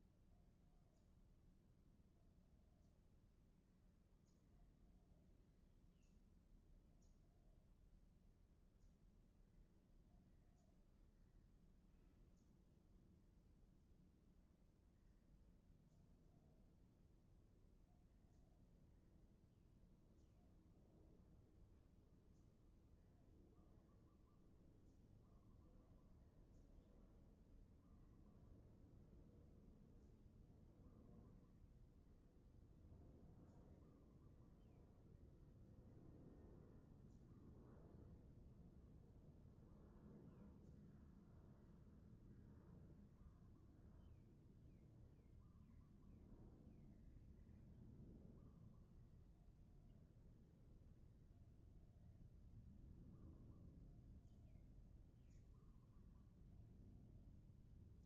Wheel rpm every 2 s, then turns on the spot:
0, 0, 0, 0, 0, 0, 0, 0, 0, 0, 0, 0, 0, 0, 0, 0, 0, 0, 0, 0, 0, 0, 0, 0, 0, 0, 0, 0, 0.
none